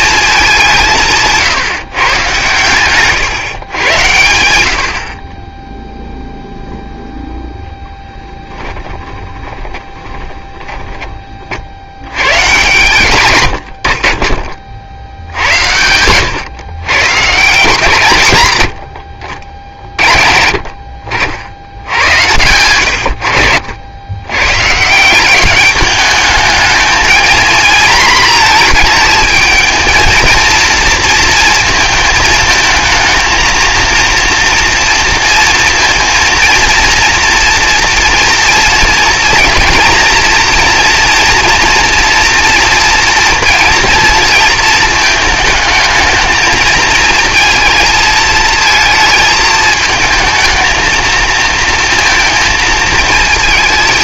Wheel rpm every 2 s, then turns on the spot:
180, 130, 70, 0, 30, 20, 140, 60, 130, 80, 50, 110, 150, 220, 220, 230, 220, 230, 240, 230, 230, 230, 220, 220, 220, 220, 220.
8-12